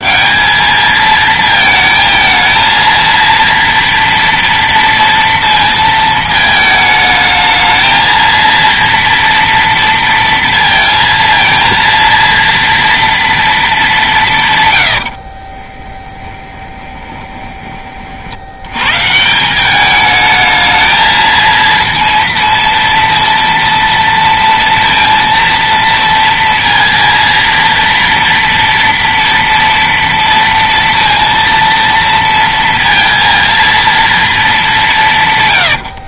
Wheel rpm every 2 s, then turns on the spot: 210, 230, 230, 220, 230, 230, 230, 120, 20, 100, 220, 230, 230, 230, 230, 230, 230, 210.
16-18